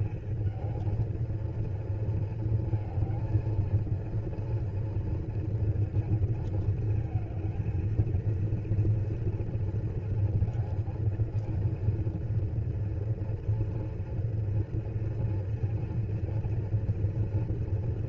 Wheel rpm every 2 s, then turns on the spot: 220, 220, 240, 230, 230, 230, 230, 230, 230.
none